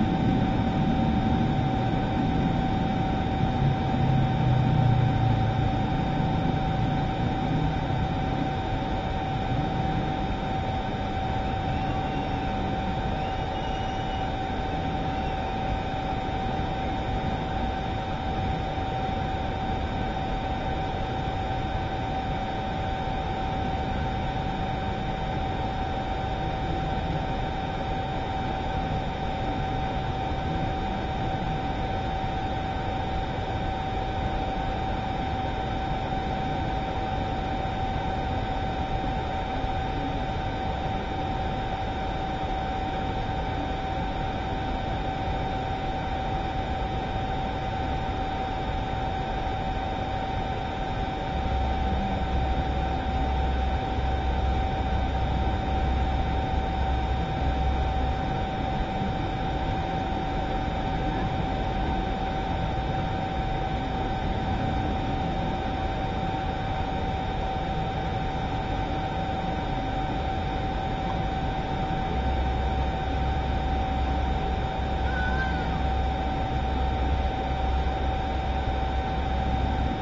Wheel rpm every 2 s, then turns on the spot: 0, 0, 0, 0, 0, 0, 0, 0, 0, 0, 0, 0, 0, 0, 0, 0, 0, 0, 0, 0, 0, 0, 0, 0, 0, 0, 0, 0, 0, 0, 0, 0, 0, 0, 0, 0, 0, 0, 0, 0.
none